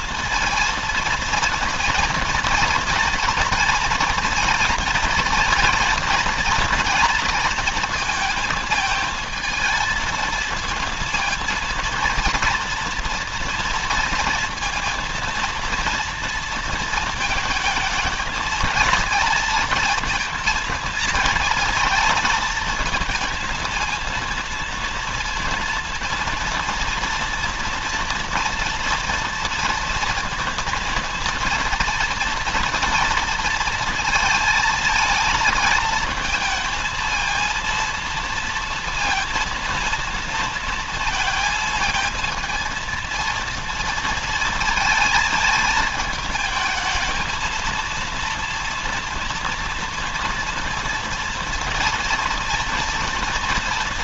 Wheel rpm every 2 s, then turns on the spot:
230, 230, 230, 230, 220, 230, 230, 230, 220, 230, 220, 220, 230, 230, 230, 230, 230, 230, 230, 230, 230, 230, 220, 220, 230, 230, 230.
none